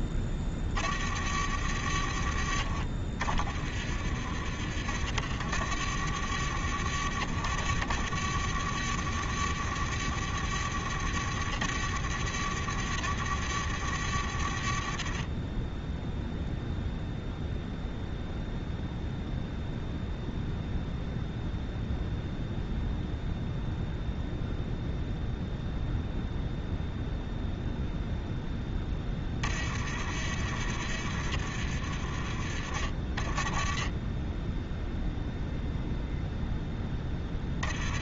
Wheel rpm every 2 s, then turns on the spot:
20, 40, 30, 50, 50, 50, 50, 40, 0, 0, 0, 0, 0, 0, 0, 40, 30, 0, 0.
none